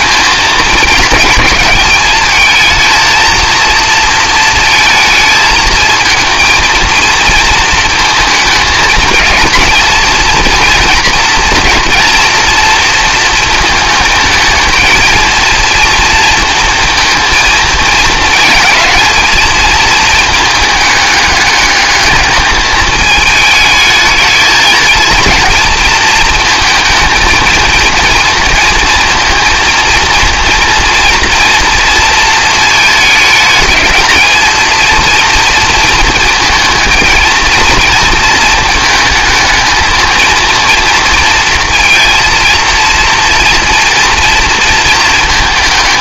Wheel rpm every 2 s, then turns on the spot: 220, 220, 220, 220, 220, 230, 240, 220, 230, 230, 210, 210, 220, 220, 230, 230, 220, 230, 230, 220, 230, 230, 230.
none